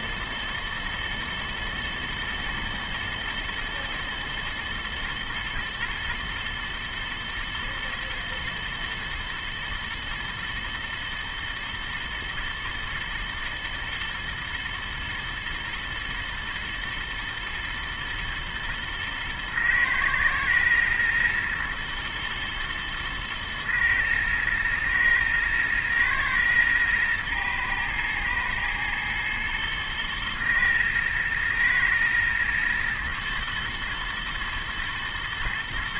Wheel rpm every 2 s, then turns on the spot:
110, 110, 120, 120, 110, 110, 110, 110, 120, 110, 110, 110, 110, 110, 110, 110, 110, 120.
none